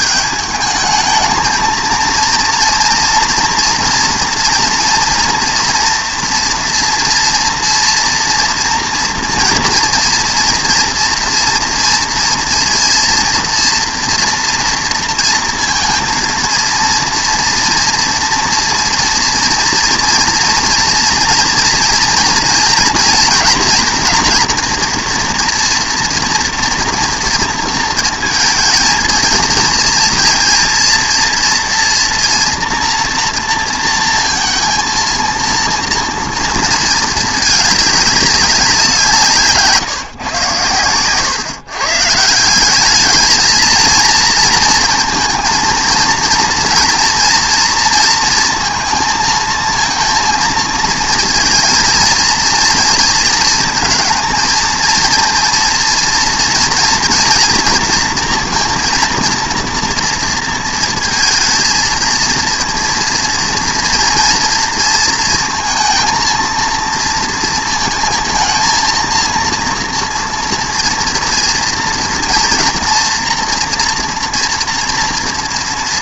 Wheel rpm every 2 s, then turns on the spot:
210, 230, 230, 240, 230, 230, 230, 230, 230, 230, 230, 230, 240, 230, 230, 230, 230, 230, 220, 170, 110, 210, 230, 230, 230, 230, 230, 230, 230, 230, 230, 230, 230, 230, 230, 230, 230, 230.
none